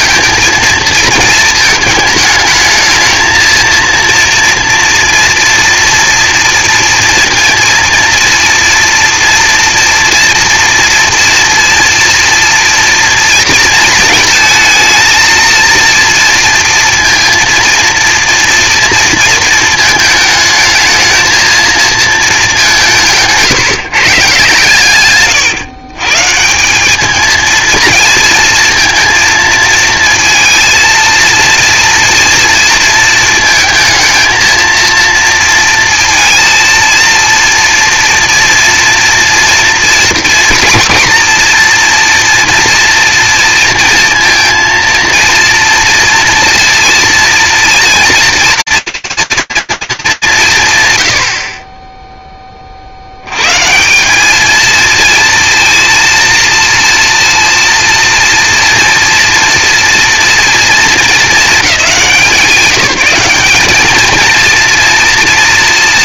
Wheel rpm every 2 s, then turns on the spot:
230, 220, 240, 230, 230, 230, 240, 220, 230, 230, 220, 190, 130, 180, 230, 230, 230, 230, 230, 230, 240, 230, 230, 230, 230, 160, 30, 220, 230, 240, 210, 190, 230.
none